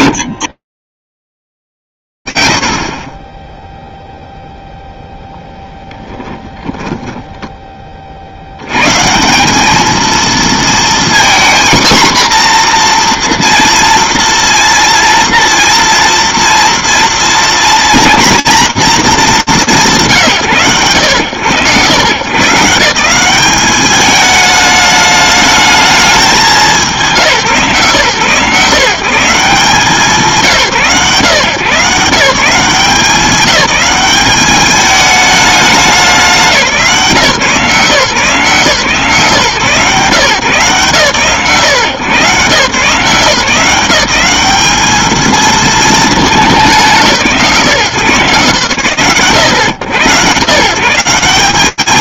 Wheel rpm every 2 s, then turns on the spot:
0, 80, 30, 10, 30, 210, 240, 230, 230, 240, 150, 130, 210, 210, 130, 140, 170, 200, 200, 160, 130, 130, 170, 230, 140, 110.
none